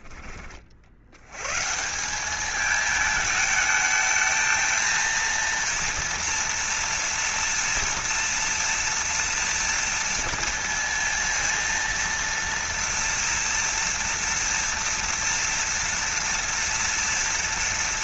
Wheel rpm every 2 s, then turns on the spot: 60, 210, 220, 230, 230, 230, 230, 230, 230.
none